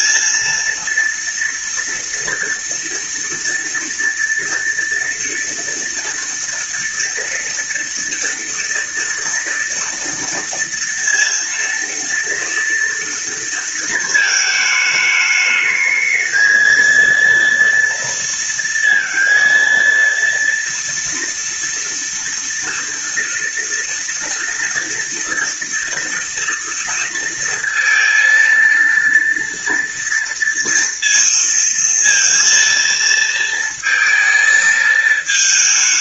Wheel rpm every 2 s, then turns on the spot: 230, 230, 230, 230, 240, 230, 230, 220, 220, 230, 230, 230, 230, 230, 230, 230, 230, 220.
none